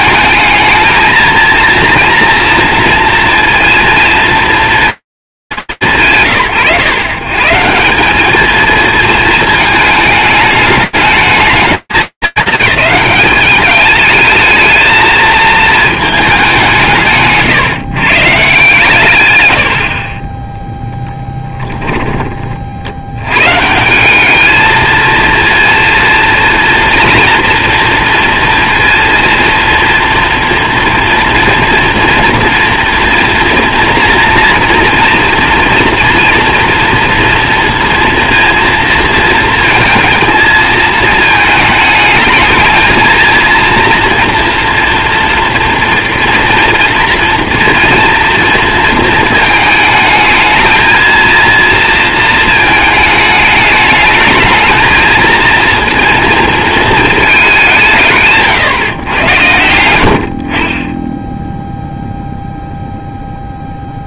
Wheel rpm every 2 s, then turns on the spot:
220, 230, 220, 110, 230, 210, 210, 220, 180, 140, 10, 50, 220, 240, 240, 230, 230, 230, 230, 230, 220, 220, 240, 230, 230, 230, 220, 220, 230, 120, 40, 0.
none